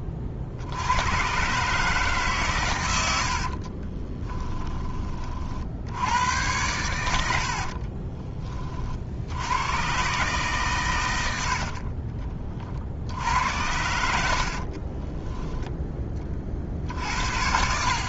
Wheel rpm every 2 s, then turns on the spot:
70, 110, 10, 100, 50, 120, 50, 30, 60.
14-16